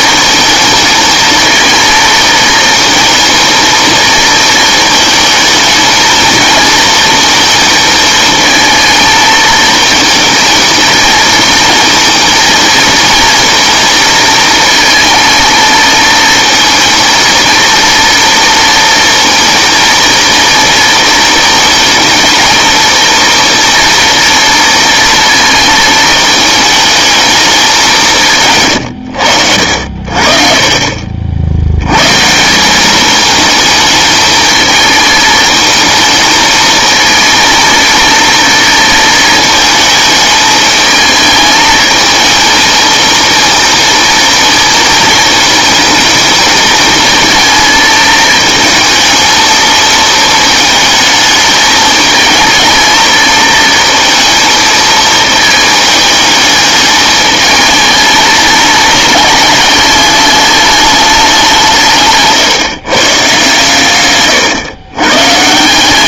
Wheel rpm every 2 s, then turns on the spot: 220, 230, 220, 230, 220, 220, 230, 220, 230, 230, 230, 220, 230, 220, 120, 50, 180, 220, 230, 230, 220, 220, 230, 220, 220, 230, 220, 220, 210, 210, 210, 130, 110.
none